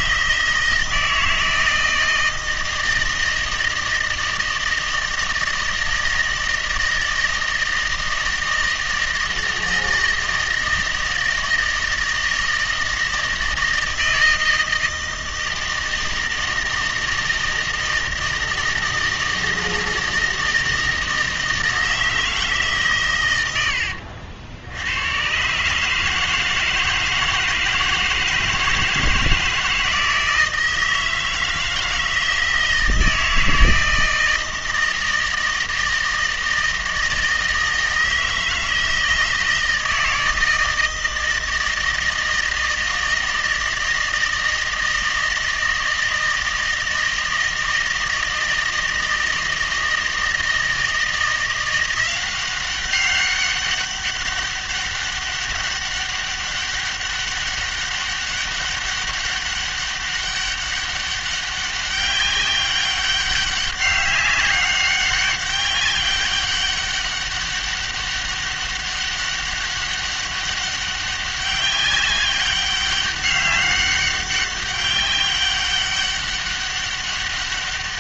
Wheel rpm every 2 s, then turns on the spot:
160, 160, 160, 160, 160, 160, 160, 160, 160, 160, 160, 150, 80, 160, 160, 160, 160, 160, 160, 160, 160, 160, 160, 160, 160, 160, 190, 200, 200, 200, 200, 190, 200, 200, 200, 200, 200, 200, 200.
none